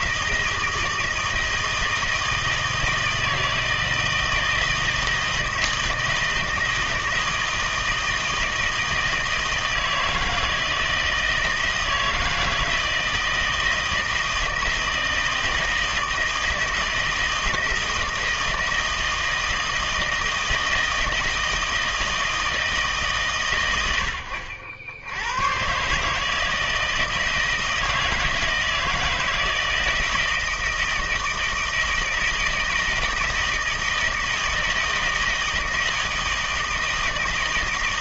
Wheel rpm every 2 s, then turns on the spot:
160, 160, 160, 160, 160, 160, 160, 160, 160, 160, 160, 160, 80, 160, 160, 160, 160, 160, 160.
none